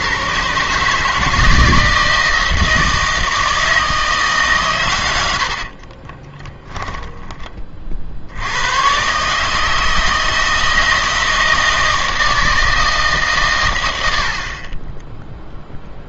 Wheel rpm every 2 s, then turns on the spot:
140, 160, 130, 10, 100, 160, 160, 40.
6-8